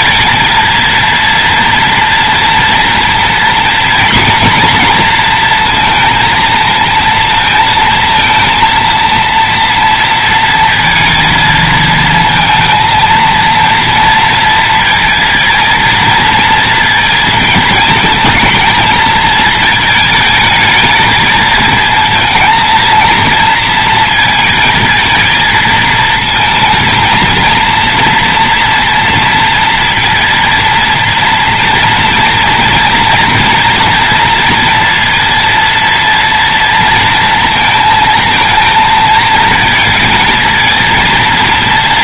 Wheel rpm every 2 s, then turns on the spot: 230, 230, 230, 220, 230, 230, 230, 230, 230, 220, 220, 220, 220, 230, 230, 230, 230, 230, 230, 230, 230.
none